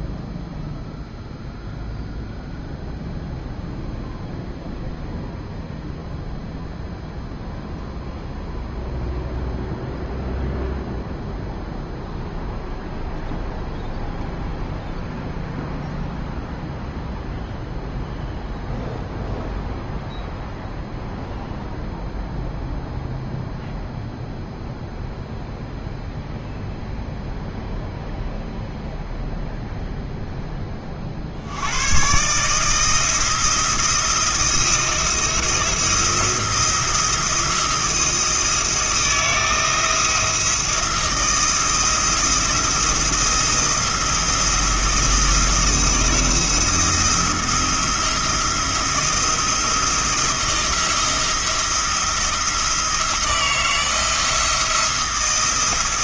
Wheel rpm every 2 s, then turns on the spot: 0, 0, 0, 0, 0, 0, 0, 0, 0, 0, 0, 0, 0, 0, 0, 30, 160, 170, 170, 160, 170, 170, 170, 160, 170, 170, 170, 170.
none